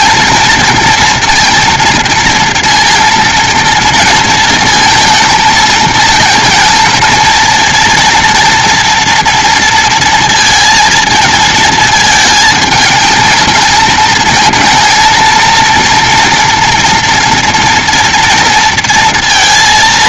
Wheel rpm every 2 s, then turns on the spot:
230, 230, 230, 230, 240, 230, 220, 220, 230, 230.
none